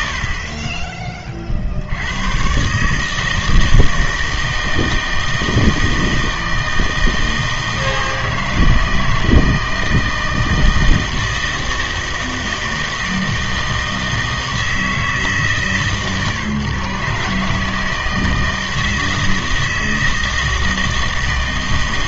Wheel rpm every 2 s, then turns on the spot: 40, 120, 160, 160, 160, 160, 160, 160, 140, 160, 160.
none